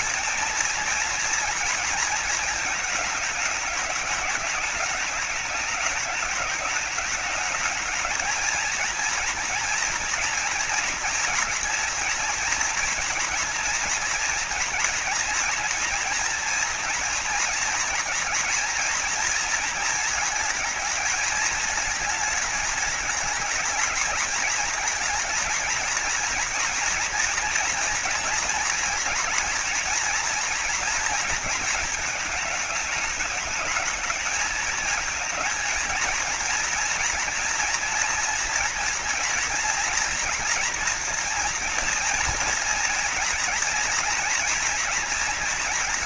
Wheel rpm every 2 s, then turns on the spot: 230, 220, 210, 210, 230, 230, 240, 230, 230, 230, 220, 220, 230, 240, 240, 230, 210, 220, 240, 230, 230, 230, 240.
none